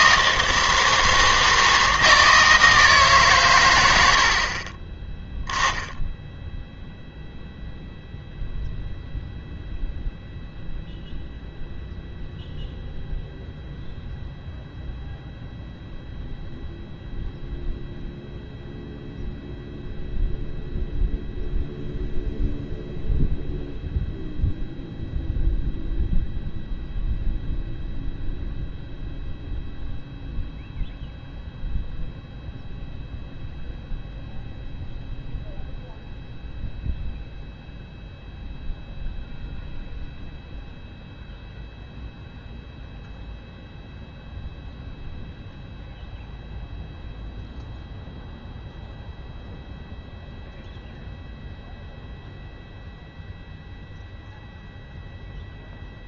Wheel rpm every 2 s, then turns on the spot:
170, 160, 20, 0, 0, 0, 0, 0, 0, 0, 0, 0, 0, 0, 0, 0, 0, 0, 0, 0, 0, 0, 0, 0, 0, 0, 0, 0.
4-6